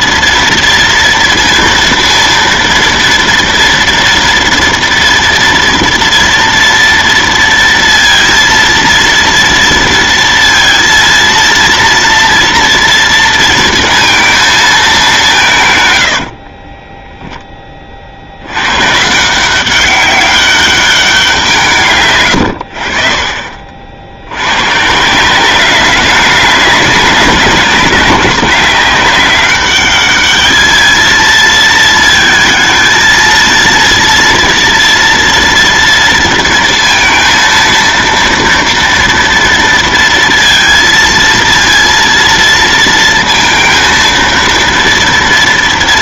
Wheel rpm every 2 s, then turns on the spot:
230, 230, 230, 230, 230, 230, 230, 220, 30, 110, 200, 70, 110, 200, 190, 220, 220, 230, 230, 230, 230, 230, 230.
16-18